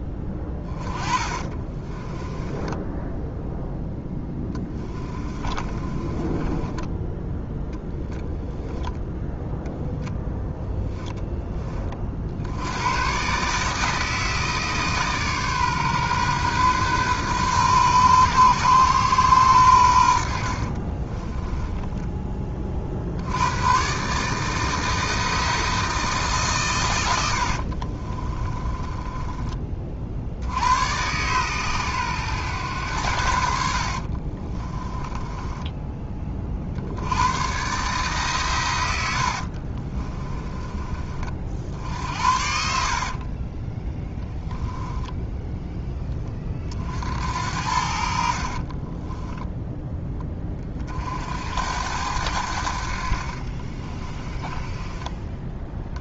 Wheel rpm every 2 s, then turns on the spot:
10, 10, 20, 10, 0, 0, 90, 150, 130, 120, 40, 50, 160, 120, 20, 100, 100, 20, 60, 100, 30, 50, 10, 50, 20, 40, 70, 10.
0-8 20-22 28-30 34-36 42-46 48-50 54-56